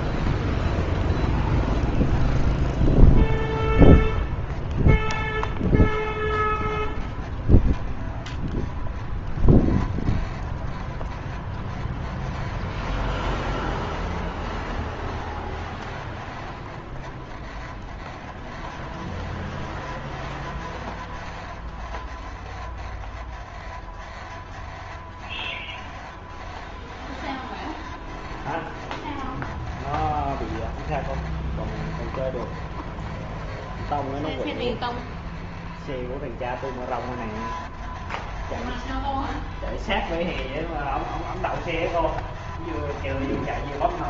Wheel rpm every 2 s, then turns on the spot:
0, 0, 0, 0, 0, 0, 0, 0, 0, 0, 0, 0, 0, 0, 0, 0, 0, 0, 0, 0, 0, 0.
none